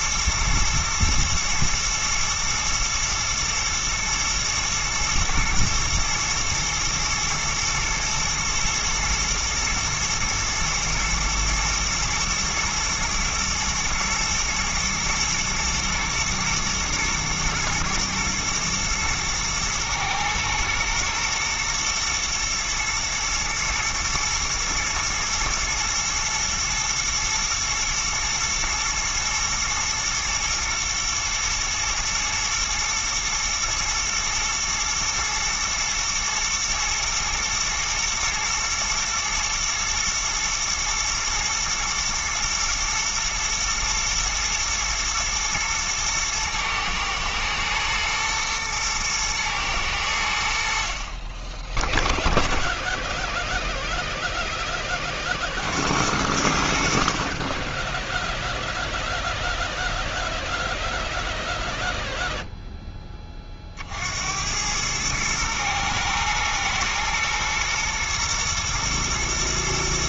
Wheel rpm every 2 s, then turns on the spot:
120, 120, 120, 110, 120, 110, 110, 110, 120, 110, 110, 110, 120, 120, 110, 110, 120, 110, 110, 110, 110, 120, 110, 110, 110, 60, 10, 10, 60, 0, 0, 0, 100, 120, 120.
none